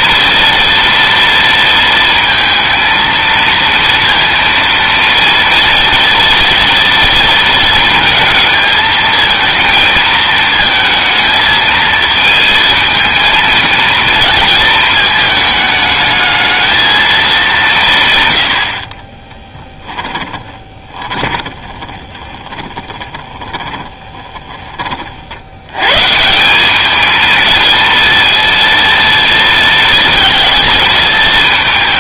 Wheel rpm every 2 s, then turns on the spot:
230, 230, 230, 230, 220, 220, 230, 220, 220, 50, 20, 20, 30, 200, 230, 220.
20-24